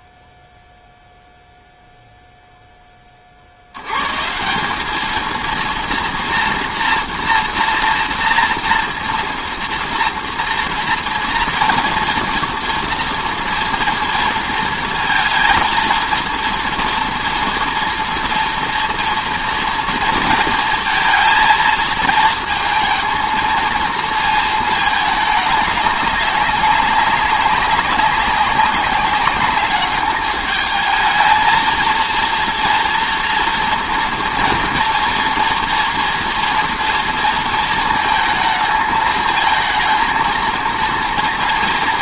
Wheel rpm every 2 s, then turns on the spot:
0, 10, 190, 230, 230, 240, 230, 230, 230, 230, 230, 230, 220, 190, 200, 220, 230, 230, 230, 220, 230.
none